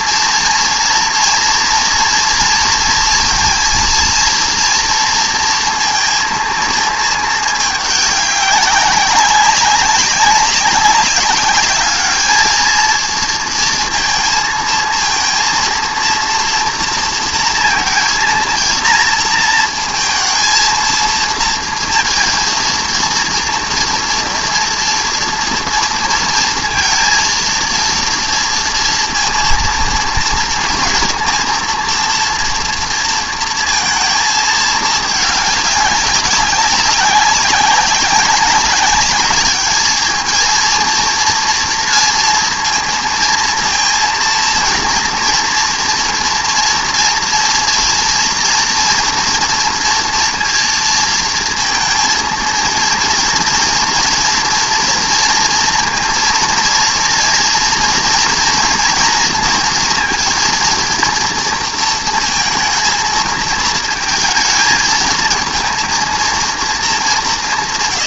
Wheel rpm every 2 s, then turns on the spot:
230, 230, 230, 220, 190, 200, 220, 230, 230, 230, 230, 230, 230, 230, 230, 230, 230, 220, 190, 200, 230, 230, 230, 230, 230, 230, 230, 230, 230, 240, 230, 220, 220, 220.
none